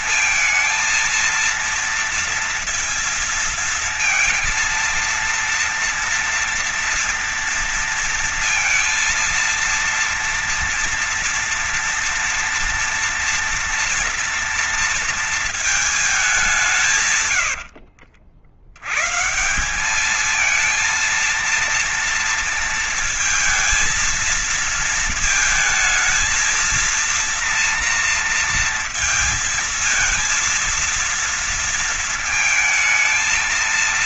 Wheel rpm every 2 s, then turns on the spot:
230, 230, 230, 230, 230, 230, 240, 230, 150, 120, 230, 230, 220, 230, 230, 230, 230.
16-18